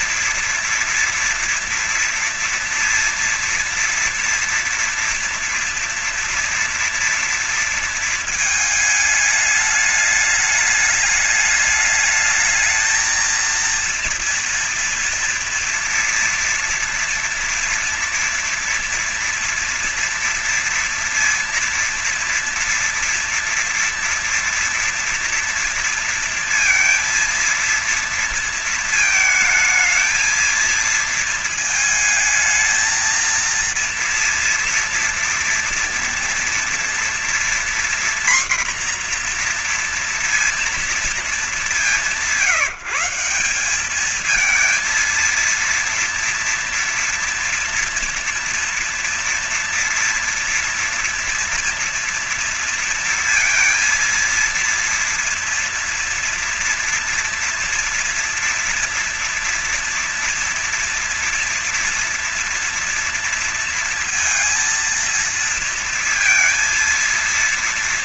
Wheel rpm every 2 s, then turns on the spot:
230, 230, 240, 240, 220, 210, 210, 230, 230, 240, 230, 230, 230, 230, 220, 220, 220, 230, 240, 250, 230, 170, 220, 230, 240, 240, 230, 230, 230, 230, 240, 240, 230, 230.
none